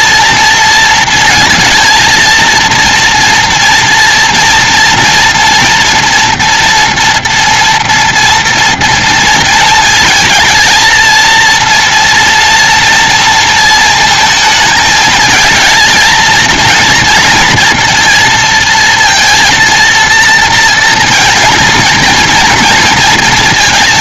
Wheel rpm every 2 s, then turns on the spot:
230, 230, 230, 230, 230, 230, 230, 220, 230, 230, 230, 230.
none